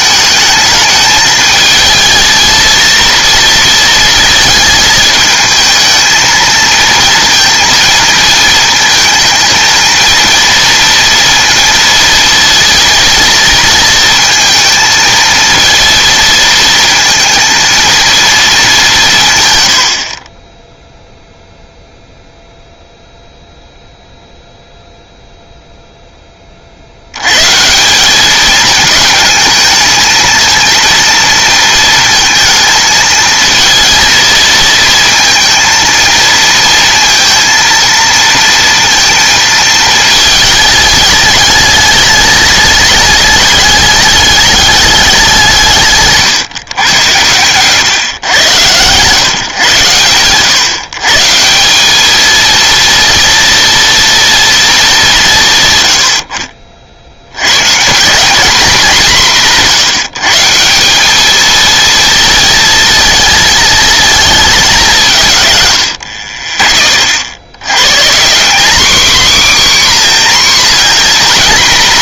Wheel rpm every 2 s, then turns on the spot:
220, 230, 220, 230, 220, 230, 230, 220, 230, 210, 10, 0, 0, 50, 220, 220, 220, 230, 230, 230, 210, 210, 210, 120, 120, 130, 230, 220, 50, 200, 180, 230, 200, 20, 220, 250.
none